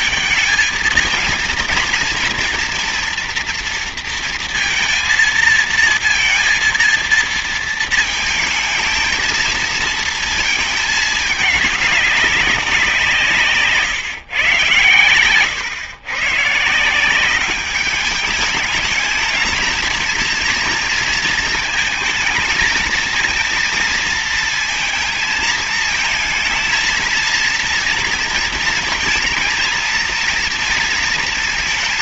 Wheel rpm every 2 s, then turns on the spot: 220, 230, 230, 230, 220, 220, 180, 120, 150, 220, 230, 220, 230, 230, 230, 230.
none